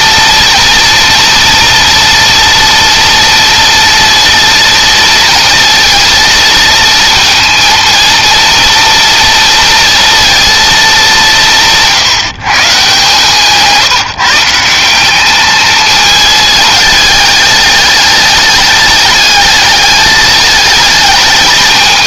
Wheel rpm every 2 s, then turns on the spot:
230, 230, 230, 230, 230, 200, 140, 180, 210, 220, 220.
none